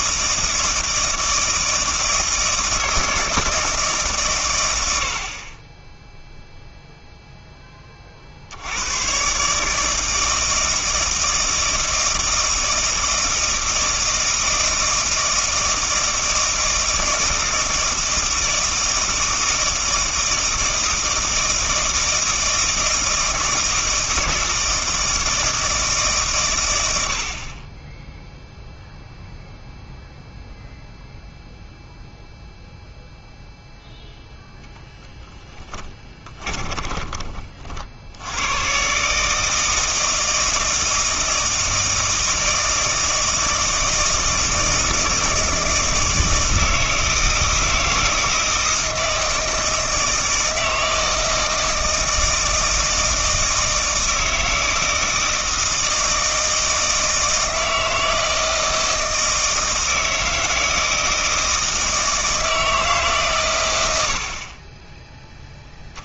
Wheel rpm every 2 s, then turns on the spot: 160, 160, 90, 0, 90, 160, 160, 160, 160, 160, 160, 160, 160, 90, 0, 0, 0, 10, 20, 120, 160, 160, 160, 160, 160, 160, 160, 160, 160, 160, 160, 160, 30.
36-38